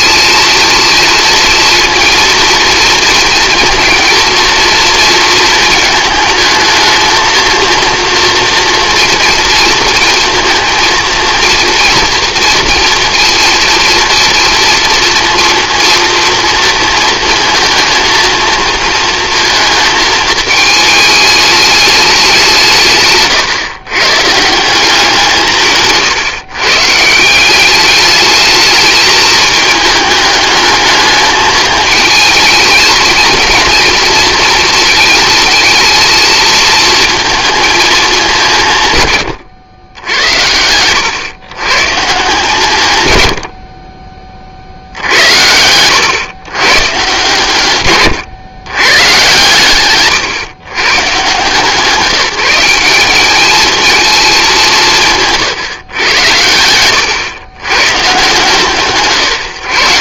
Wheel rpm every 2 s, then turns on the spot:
230, 230, 230, 220, 230, 230, 230, 230, 230, 230, 220, 160, 180, 140, 220, 210, 220, 230, 230, 160, 100, 140, 50, 130, 120, 130, 190, 190, 90, 140.
none